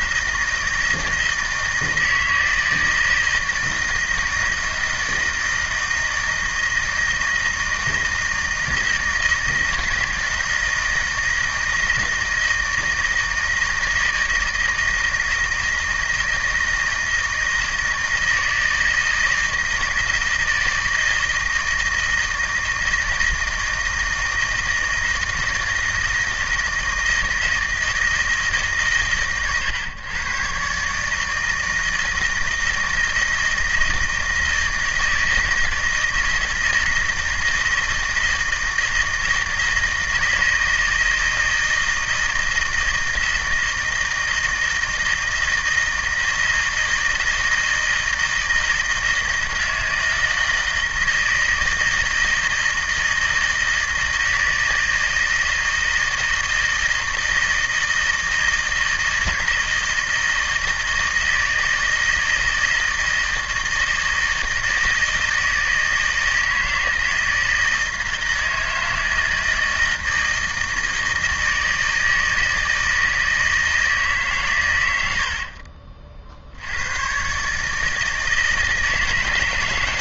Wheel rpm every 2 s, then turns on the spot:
160, 160, 160, 160, 160, 160, 160, 160, 160, 160, 160, 160, 160, 160, 130, 140, 160, 160, 160, 160, 160, 160, 160, 160, 160, 160, 160, 170, 160, 160, 160, 160, 160, 160, 160, 160, 160, 90, 110, 150.
none